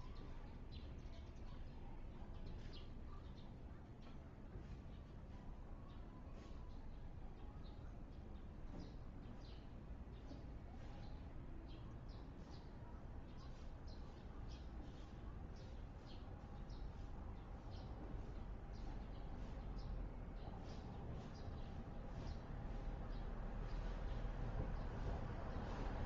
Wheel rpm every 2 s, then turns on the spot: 0, 0, 0, 0, 0, 0, 0, 0, 0, 0, 0, 0, 0.
none